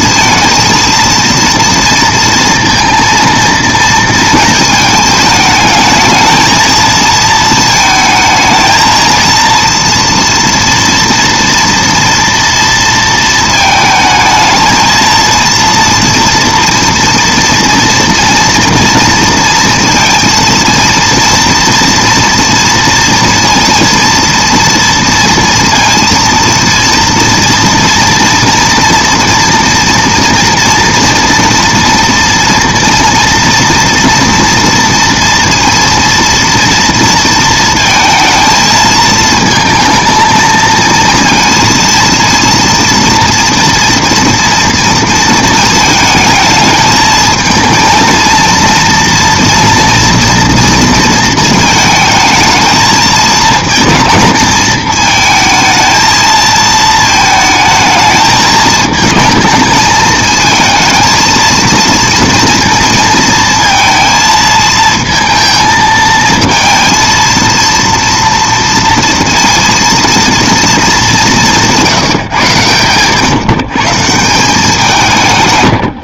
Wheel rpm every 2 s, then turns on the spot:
230, 230, 220, 220, 230, 230, 230, 220, 230, 230, 230, 230, 230, 230, 230, 230, 230, 230, 230, 220, 230, 230, 230, 220, 230, 230, 220, 220, 220, 220, 220, 230, 220, 230, 230, 230, 130, 170.
none